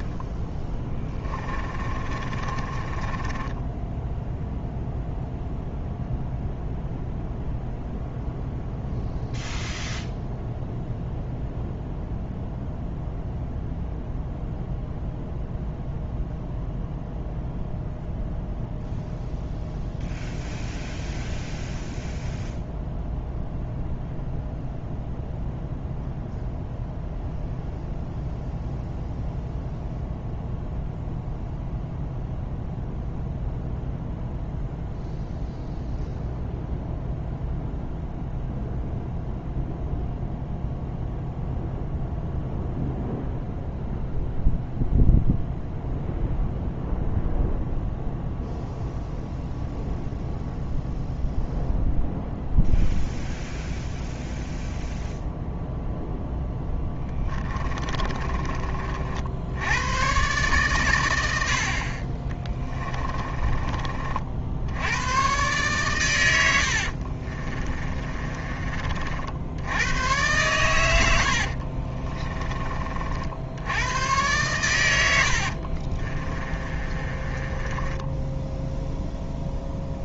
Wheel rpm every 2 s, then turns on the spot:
10, 20, 0, 0, 0, 0, 0, 0, 0, 0, 0, 0, 0, 0, 0, 0, 0, 0, 0, 0, 0, 0, 0, 0, 0, 0, 0, 0, 10, 60, 120, 20, 90, 60, 40, 100, 40, 100, 30, 0.
0-2 56-58 62-64 66-68 76-78